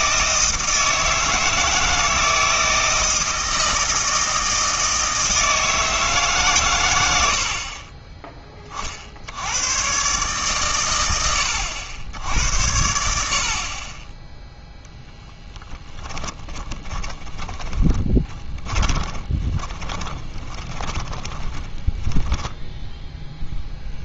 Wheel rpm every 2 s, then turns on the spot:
160, 160, 160, 120, 30, 120, 80, 10, 30, 20, 20, 10.
14-24